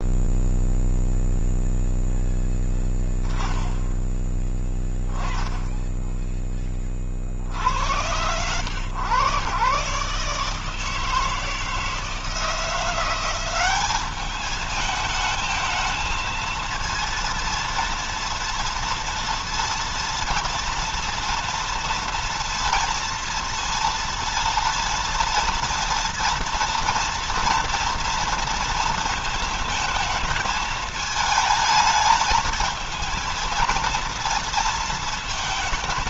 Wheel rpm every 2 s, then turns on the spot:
0, 10, 10, 10, 100, 150, 170, 210, 230, 230, 230, 230, 230, 230, 230, 220, 220, 230.
none